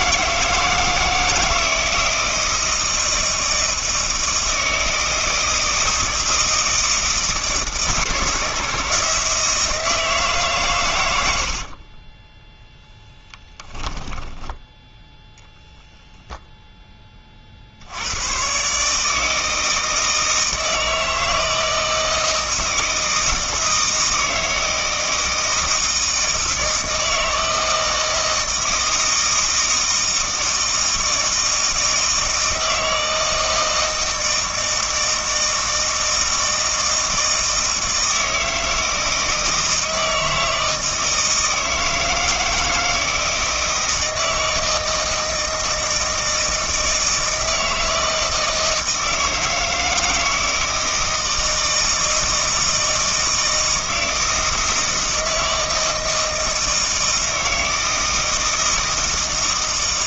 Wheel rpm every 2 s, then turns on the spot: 160, 160, 160, 160, 160, 120, 0, 10, 10, 130, 160, 160, 160, 160, 160, 160, 160, 160, 160, 160, 160, 160, 160, 160, 160, 160, 160, 160, 160, 160.
none